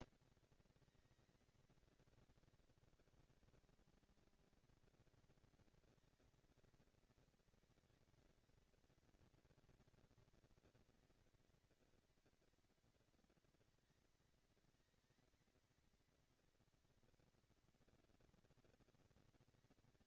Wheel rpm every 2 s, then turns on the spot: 220, 230, 230, 230, 230, 230, 230, 220, 230, 230.
none